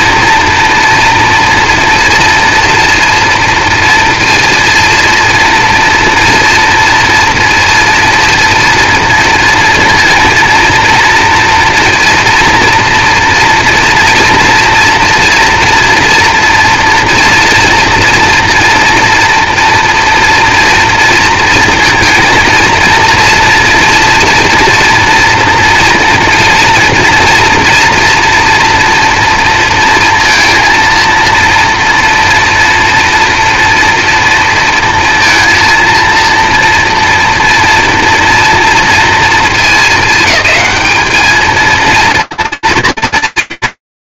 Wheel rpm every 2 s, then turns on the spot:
240, 230, 230, 230, 230, 230, 240, 230, 230, 240, 230, 230, 240, 230, 240, 230, 230, 230, 230, 230, 210, 230.
none